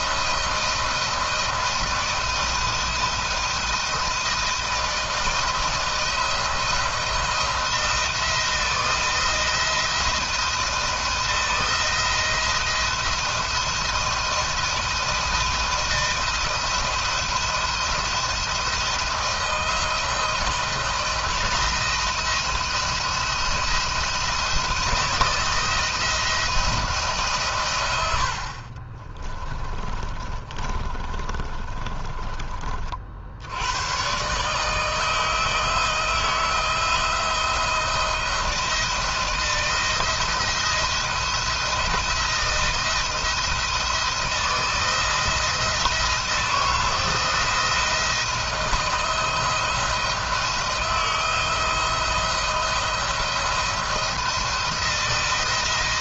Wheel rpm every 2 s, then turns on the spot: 160, 160, 160, 170, 160, 170, 170, 170, 170, 170, 170, 170, 170, 150, 30, 40, 70, 160, 170, 160, 170, 160, 160, 160, 170, 160, 170, 170.
28-32